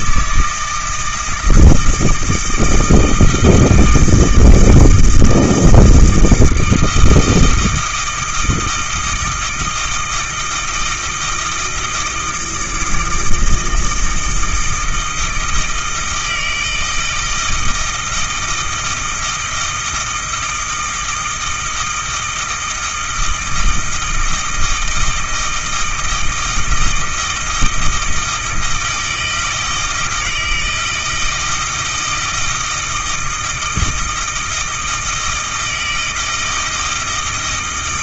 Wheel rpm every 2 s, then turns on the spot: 160, 160, 160, 160, 160, 160, 160, 160, 160, 160, 160, 160, 160, 160, 160, 160, 160, 160, 160.
none